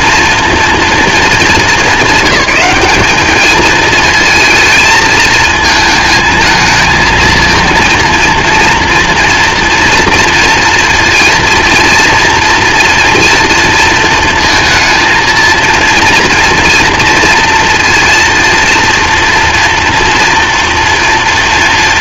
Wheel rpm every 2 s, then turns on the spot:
210, 200, 220, 220, 230, 230, 230, 230, 230, 230, 230.
none